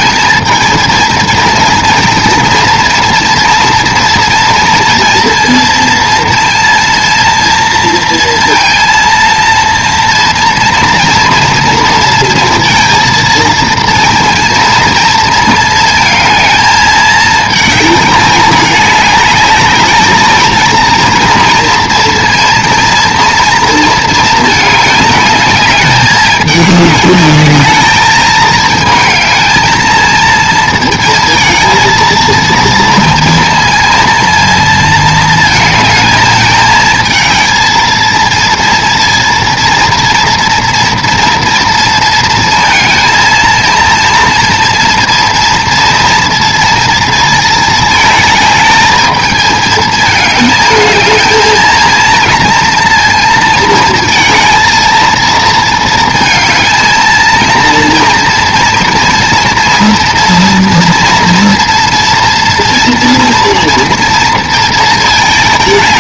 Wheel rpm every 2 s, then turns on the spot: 230, 230, 230, 230, 230, 230, 230, 230, 220, 210, 230, 230, 210, 210, 220, 220, 230, 230, 220, 230, 230, 230, 230, 230, 220, 220, 230, 230, 230, 230, 230, 230, 220.
none